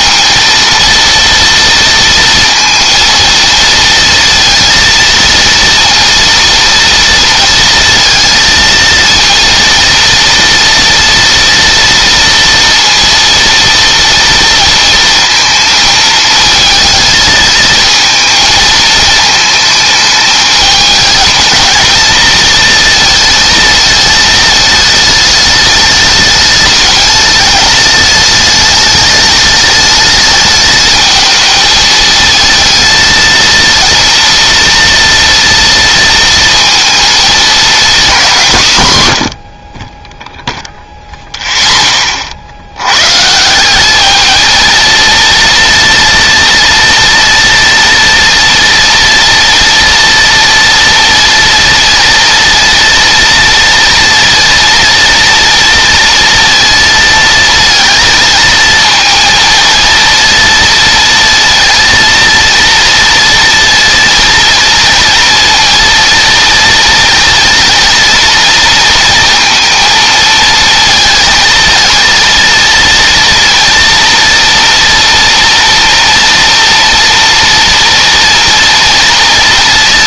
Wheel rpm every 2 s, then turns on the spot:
230, 230, 230, 230, 230, 230, 230, 230, 220, 220, 210, 230, 210, 210, 210, 220, 220, 230, 230, 130, 0, 110, 230, 230, 230, 230, 230, 230, 230, 230, 230, 230, 230, 230, 230, 230, 230, 230, 230, 230.
none